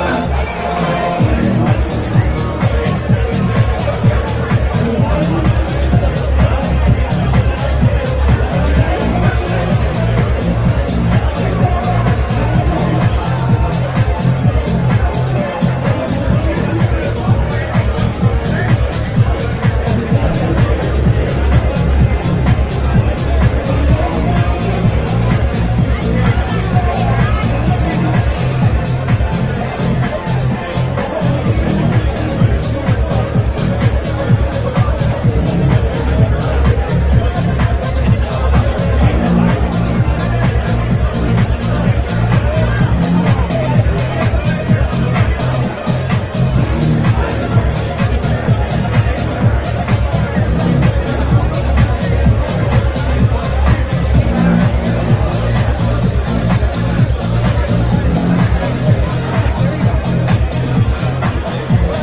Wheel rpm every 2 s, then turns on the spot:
0, 0, 0, 0, 0, 0, 0, 0, 0, 0, 0, 0, 0, 0, 0, 0, 0, 0, 0, 0, 0, 0, 0, 0, 0, 0, 0, 0, 0, 0, 0.
none